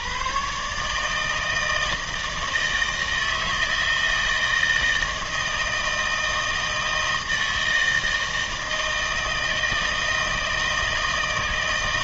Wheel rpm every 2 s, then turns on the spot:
130, 160, 160, 160, 160, 160.
none